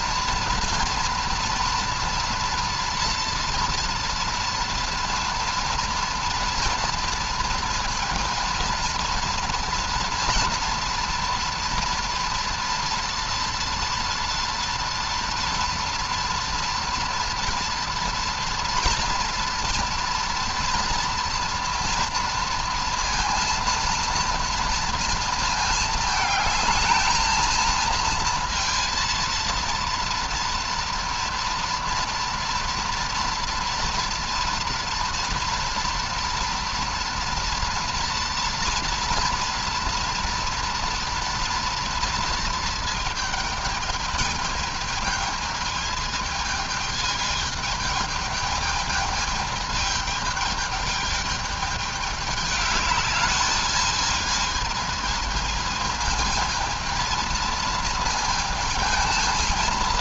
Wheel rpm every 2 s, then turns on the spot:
230, 230, 230, 230, 230, 240, 230, 230, 230, 230, 230, 230, 230, 220, 230, 230, 230, 230, 230, 230, 230, 230, 220, 220, 220, 220, 210, 220, 220, 220.
none